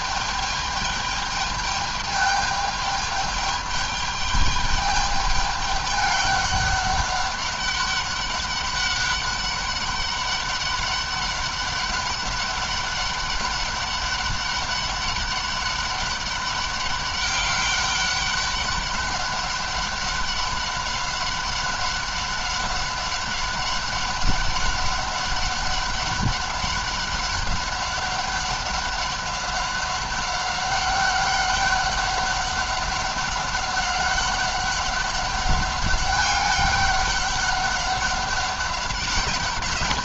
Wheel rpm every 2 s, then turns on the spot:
210, 210, 210, 200, 200, 200, 200, 200, 200, 200, 190, 200, 200, 200, 200, 200, 200, 200, 200, 190.
none